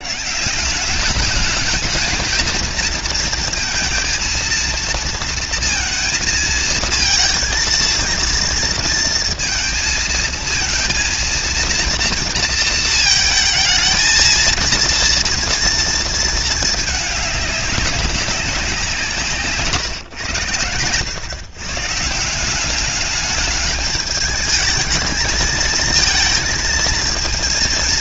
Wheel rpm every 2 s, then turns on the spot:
170, 230, 230, 230, 230, 230, 230, 220, 220, 190, 110, 180, 220, 230.
none